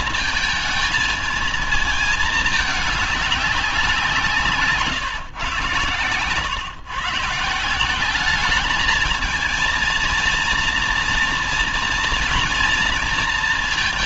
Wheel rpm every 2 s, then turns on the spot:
220, 210, 150, 110, 210, 230, 230.
none